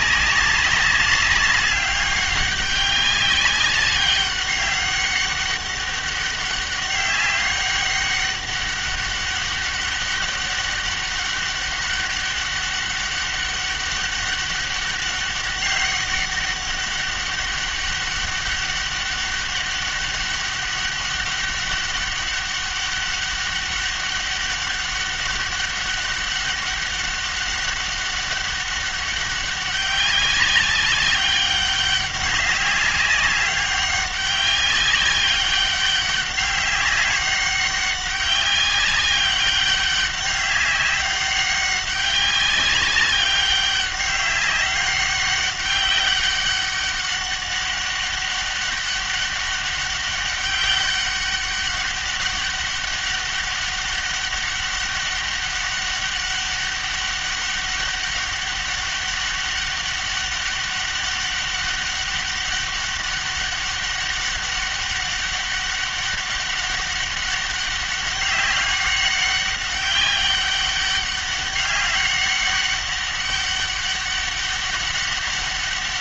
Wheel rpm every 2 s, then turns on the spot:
200, 200, 200, 200, 200, 200, 200, 200, 200, 200, 200, 200, 200, 200, 200, 200, 200, 190, 200, 200, 190, 200, 190, 200, 200, 200, 200, 200, 200, 200, 200, 200, 200, 200, 200, 200, 200, 200.
none